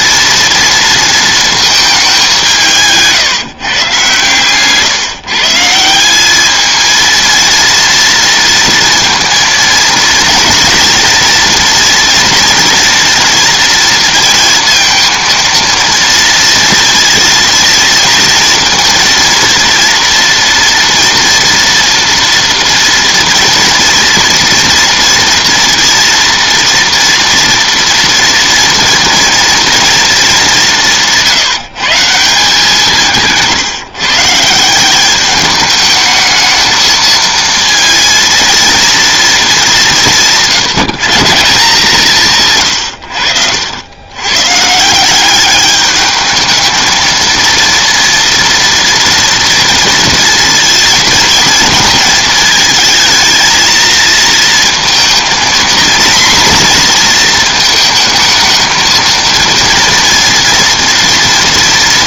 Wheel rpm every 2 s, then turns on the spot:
230, 180, 140, 220, 230, 240, 240, 230, 230, 230, 230, 230, 230, 230, 230, 190, 170, 170, 220, 230, 170, 120, 160, 220, 230, 230, 220, 230, 240, 220, 230.
none